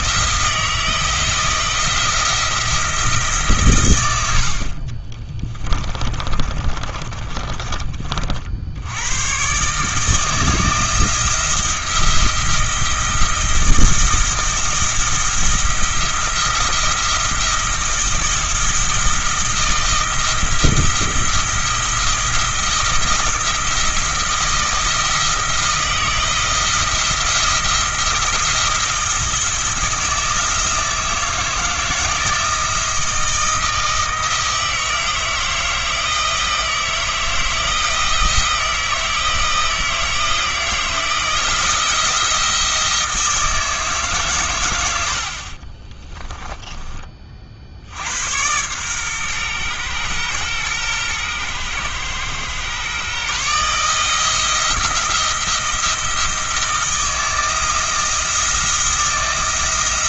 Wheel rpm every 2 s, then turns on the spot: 160, 170, 40, 40, 80, 160, 170, 170, 170, 170, 170, 170, 160, 160, 170, 160, 160, 160, 160, 160, 160, 170, 100, 20, 120, 120, 130, 170, 160, 160.
6-8